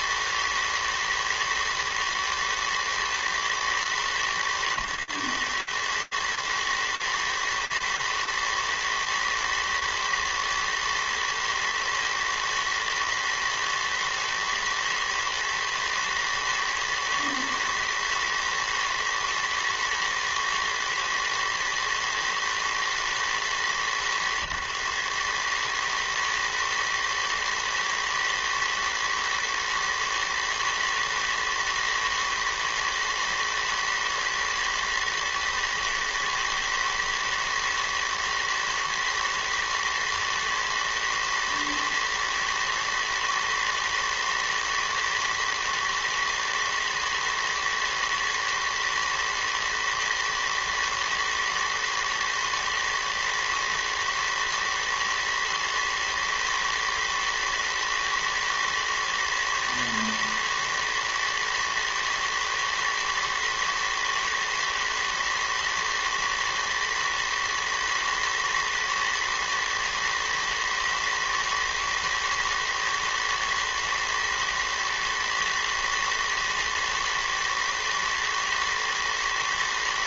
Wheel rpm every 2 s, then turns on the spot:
120, 110, 110, 110, 110, 120, 120, 110, 110, 110, 110, 100, 110, 110, 110, 120, 110, 110, 110, 110, 110, 110, 120, 120, 110, 110, 110, 110, 120, 110, 110, 110, 110, 110, 110, 110, 110, 110, 110, 120.
none